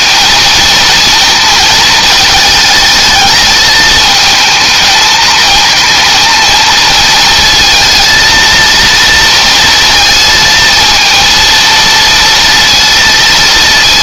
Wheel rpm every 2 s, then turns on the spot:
230, 220, 220, 230, 230, 230, 230.
none